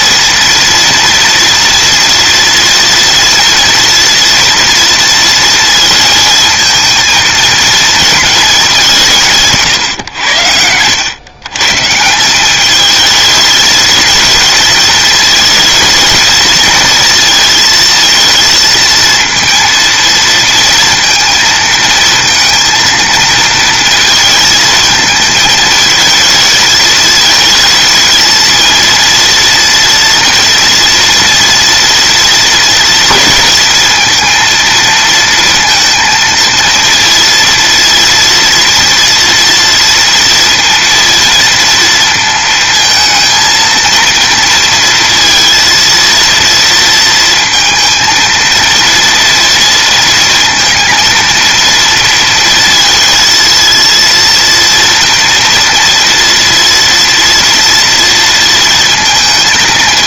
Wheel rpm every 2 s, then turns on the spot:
230, 230, 230, 230, 190, 100, 210, 220, 230, 220, 230, 230, 230, 220, 230, 230, 220, 230, 230, 230, 230, 220, 230, 230, 230, 230, 230, 230, 230, 230.
none